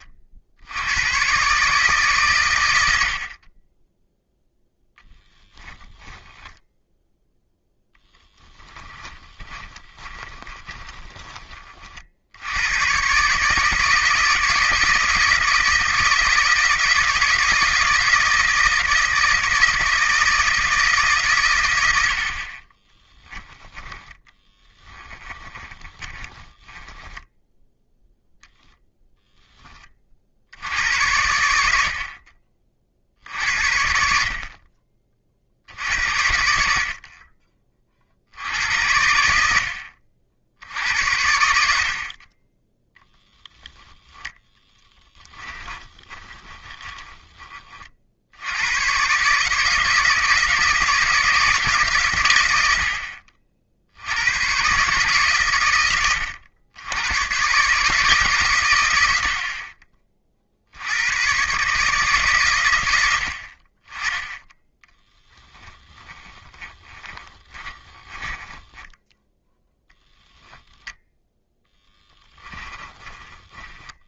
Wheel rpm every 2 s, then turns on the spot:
100, 90, 0, 10, 10, 20, 120, 160, 170, 160, 150, 20, 10, 10, 0, 80, 50, 30, 50, 70, 70, 10, 10, 20, 110, 160, 70, 130, 90, 100, 80, 100, 10, 30, 10, 0, 10.
8-12 22-28 44-48 66-70 72-74